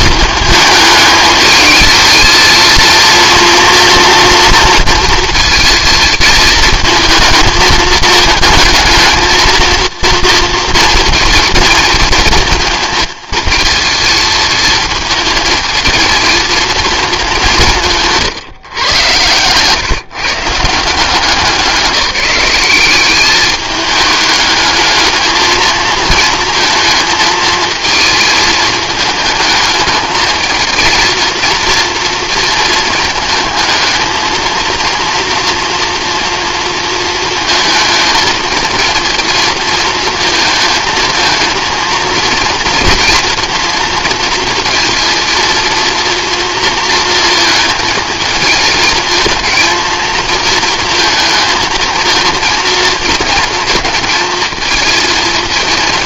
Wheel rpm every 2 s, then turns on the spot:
220, 230, 230, 220, 220, 230, 220, 220, 220, 130, 170, 190, 210, 220, 220, 220, 230, 230, 230, 220, 220, 230, 230, 230, 220, 220, 220, 220.
none